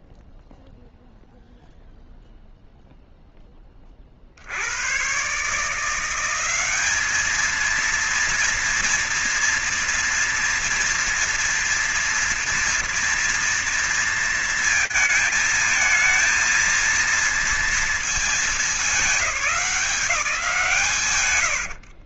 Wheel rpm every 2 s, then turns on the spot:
0, 0, 10, 130, 210, 230, 230, 230, 230, 230, 200.
none